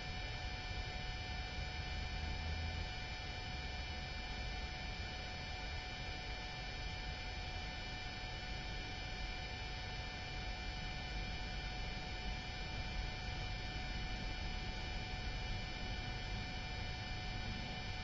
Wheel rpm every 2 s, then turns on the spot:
0, 0, 0, 0, 0, 0, 0, 0, 0.
none